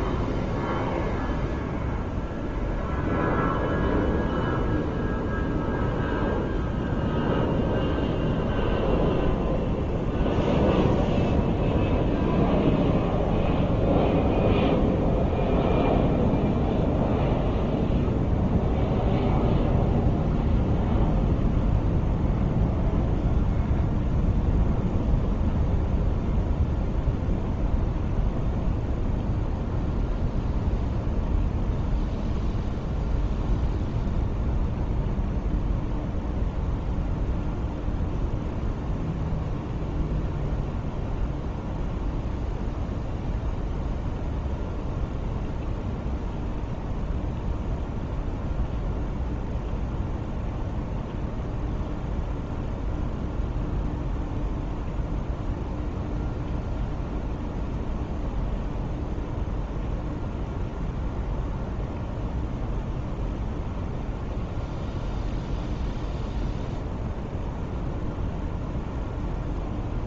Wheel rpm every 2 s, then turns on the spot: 0, 0, 0, 0, 0, 0, 0, 0, 0, 0, 0, 0, 0, 0, 0, 0, 0, 0, 0, 0, 0, 0, 0, 0, 0, 0, 0, 0, 0, 0, 0, 0, 0, 0, 0.
none